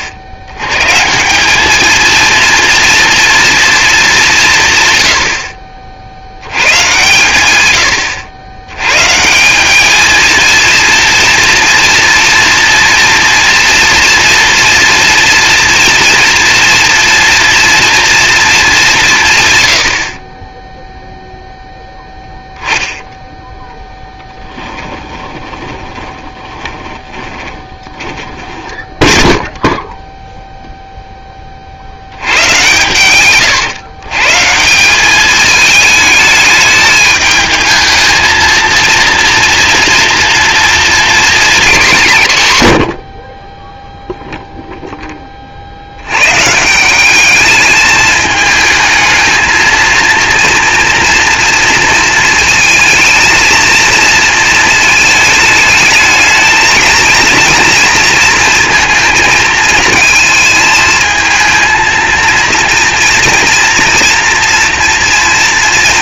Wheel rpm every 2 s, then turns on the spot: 90, 230, 130, 110, 100, 230, 230, 230, 230, 210, 10, 0, 10, 10, 10, 0, 110, 170, 210, 230, 230, 110, 0, 160, 220, 230, 230, 220, 220, 230, 220, 230, 230.
24-30